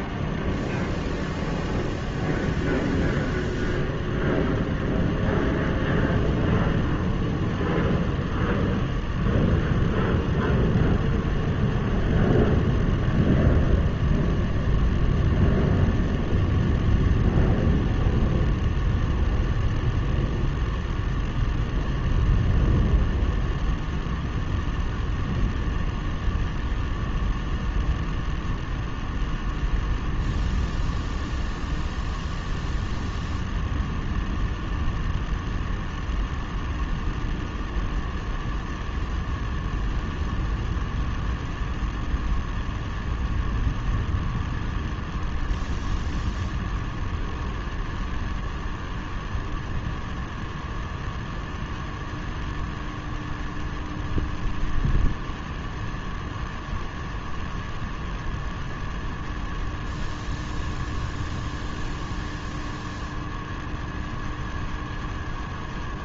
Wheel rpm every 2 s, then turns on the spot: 0, 0, 0, 0, 0, 0, 0, 0, 0, 0, 0, 0, 0, 0, 0, 0, 0, 0, 0, 0, 0, 0, 0, 0, 0, 0, 0, 0, 0, 0, 0, 0, 0.
none